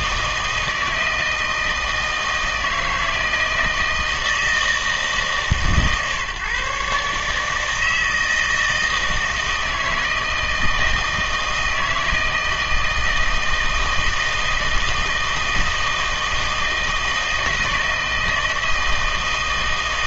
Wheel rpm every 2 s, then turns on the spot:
160, 160, 160, 140, 160, 160, 160, 160, 160, 160.
none